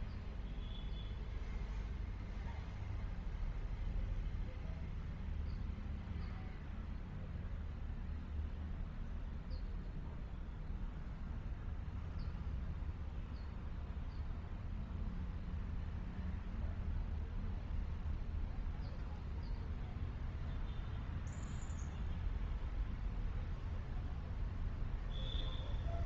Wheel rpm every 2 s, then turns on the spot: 0, 0, 0, 0, 0, 0, 0, 0, 0, 0, 0, 0, 0.
none